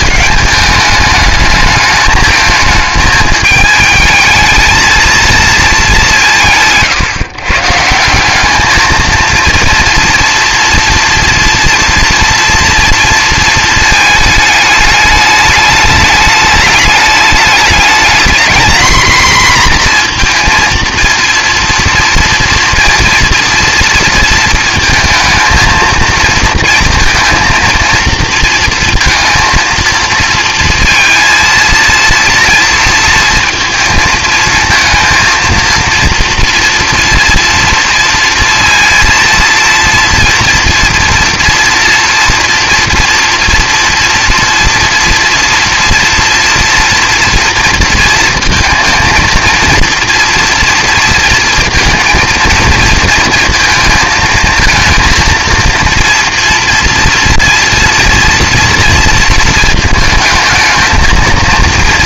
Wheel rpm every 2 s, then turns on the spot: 210, 220, 230, 140, 210, 230, 230, 210, 210, 230, 230, 230, 230, 230, 230, 230, 230, 230, 230, 230, 230, 230, 230, 240, 230, 230, 230, 230, 230, 230, 220.
none